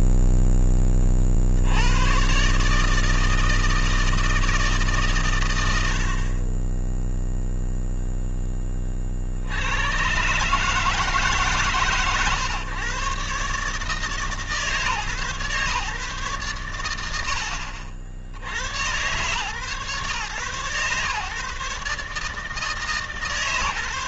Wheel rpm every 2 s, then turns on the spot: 20, 140, 150, 20, 20, 150, 130, 150, 120, 90, 120, 150.
none